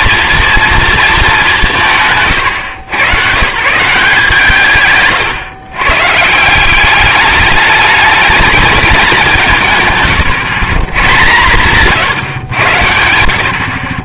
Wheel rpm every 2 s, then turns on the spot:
230, 120, 150, 180, 210, 140, 90.
none